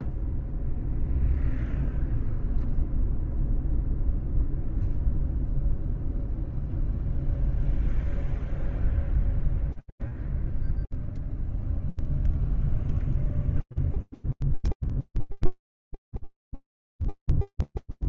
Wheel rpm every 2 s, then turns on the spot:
0, 0, 0, 0, 0, 0, 0, 0, 0.
none